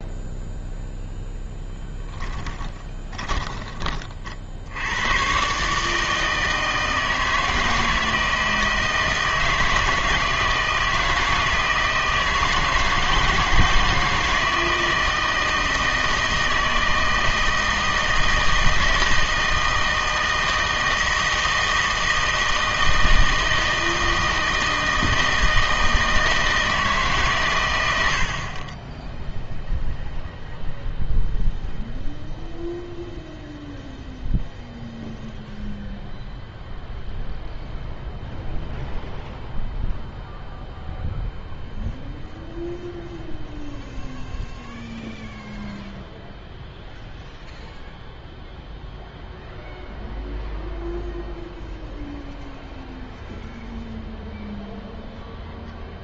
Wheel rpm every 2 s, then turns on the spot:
0, 20, 80, 160, 160, 160, 160, 160, 160, 160, 160, 160, 160, 160, 30, 0, 0, 0, 0, 0, 0, 0, 0, 0, 0, 0, 0, 0.
2-4